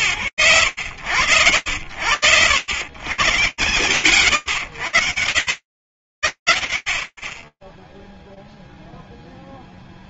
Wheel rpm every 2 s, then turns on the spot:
80, 120, 80, 0, 0.
none